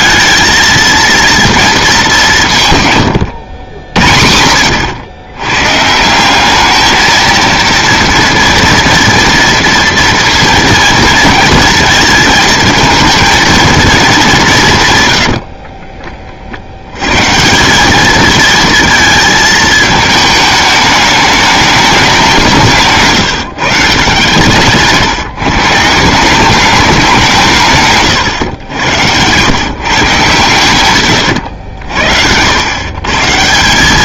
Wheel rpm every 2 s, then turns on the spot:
230, 140, 70, 200, 230, 230, 220, 180, 70, 230, 210, 160, 140, 200, 110, 130, 110.
none